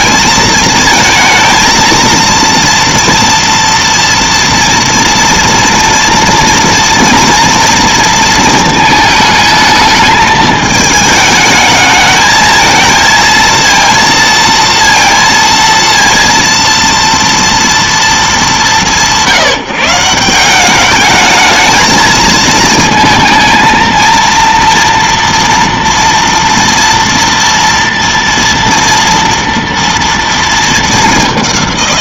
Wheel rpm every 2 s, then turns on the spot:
220, 230, 230, 240, 220, 220, 220, 230, 230, 160, 190, 220, 230, 240, 230, 220.
none